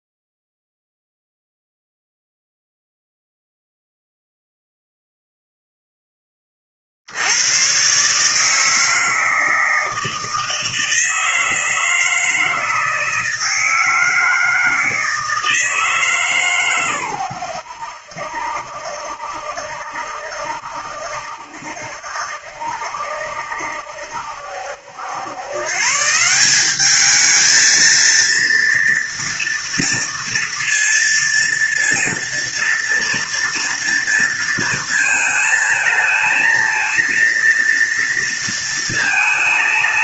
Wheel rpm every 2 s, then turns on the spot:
0, 0, 0, 30, 150, 160, 160, 160, 130, 70, 70, 70, 70, 180, 230, 230, 230, 230, 220, 230.
none